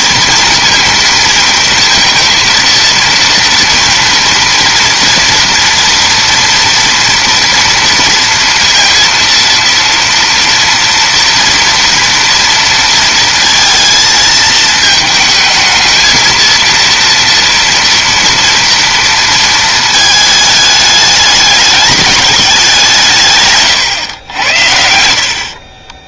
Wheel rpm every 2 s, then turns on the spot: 230, 230, 230, 230, 230, 230, 230, 220, 230, 230, 210, 170, 70.
none